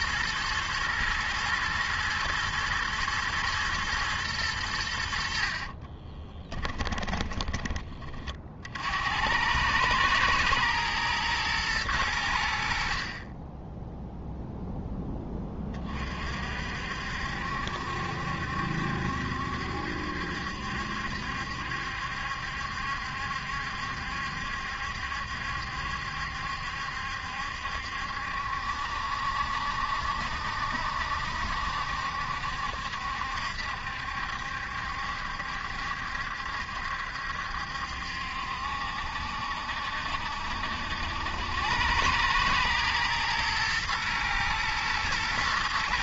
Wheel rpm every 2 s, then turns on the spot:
110, 120, 90, 20, 50, 110, 60, 0, 60, 70, 70, 70, 70, 70, 70, 70, 70, 70, 70, 70, 70, 110, 110.
6-8